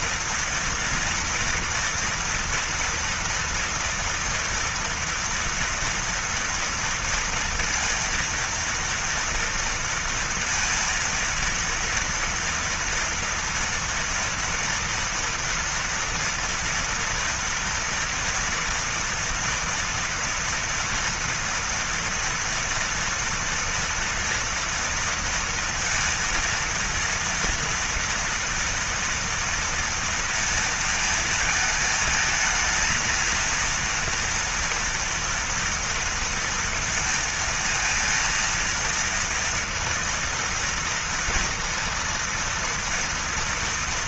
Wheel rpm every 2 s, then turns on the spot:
240, 230, 230, 230, 230, 230, 230, 230, 230, 230, 230, 230, 230, 230, 230, 230, 220, 230, 240, 230, 230, 230.
none